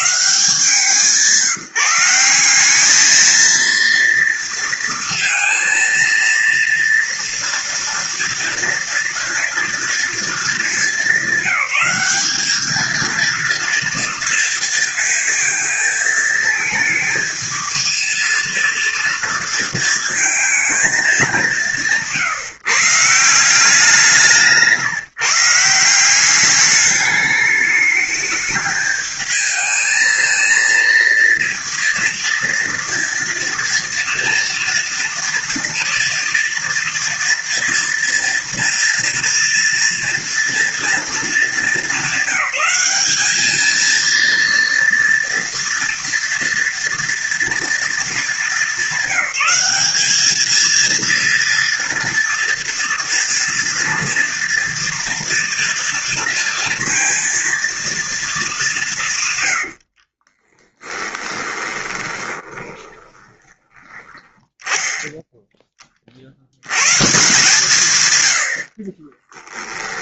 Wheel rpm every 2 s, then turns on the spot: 170, 200, 230, 230, 230, 210, 210, 230, 230, 230, 220, 140, 160, 210, 220, 230, 230, 230, 230, 230, 230, 200, 230, 230, 200, 230, 240, 230, 230, 190, 20, 20, 10, 120, 40.
60-64 68-70